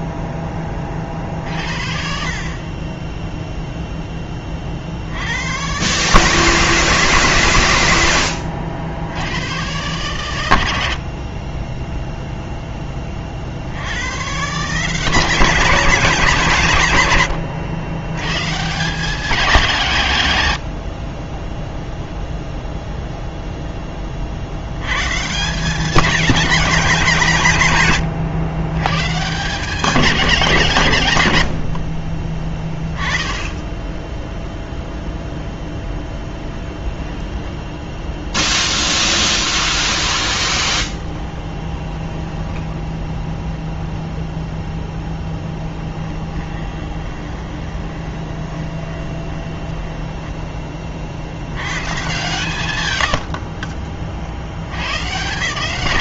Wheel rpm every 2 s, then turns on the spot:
20, 40, 40, 140, 70, 80, 10, 160, 160, 150, 100, 0, 90, 210, 120, 180, 20, 0, 10, 0, 20, 10, 0, 10, 20, 20, 140, 100.
36-38 40-44 46-50